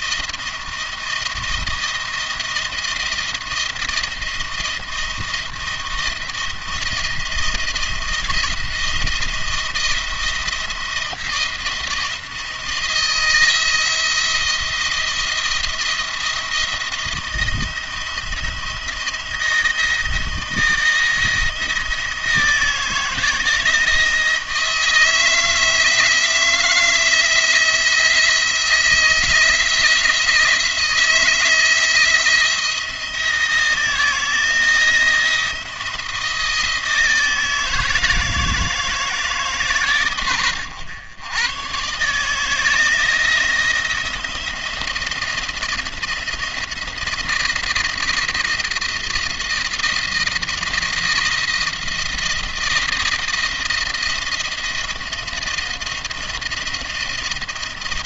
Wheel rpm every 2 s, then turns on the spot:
170, 170, 170, 170, 160, 170, 170, 170, 170, 170, 160, 160, 160, 170, 170, 170, 170, 170, 170, 160, 110, 160, 160, 170, 170, 170, 170, 170, 170.
none